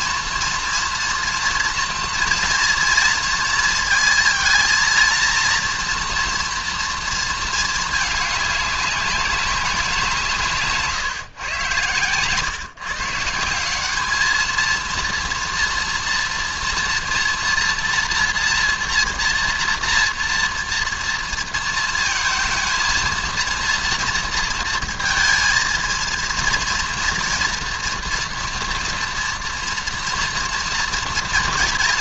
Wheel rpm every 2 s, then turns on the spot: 230, 230, 230, 230, 200, 150, 150, 230, 230, 230, 240, 230, 230, 230, 230, 230.
none